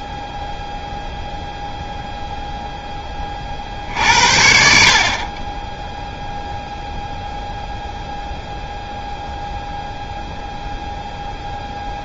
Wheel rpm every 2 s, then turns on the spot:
0, 0, 50, 0, 0, 0.
none